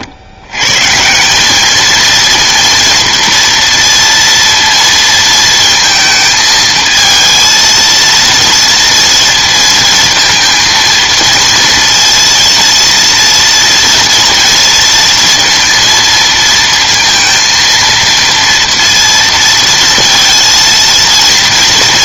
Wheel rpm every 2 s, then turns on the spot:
120, 230, 230, 220, 230, 230, 230, 230, 230, 230, 230.
none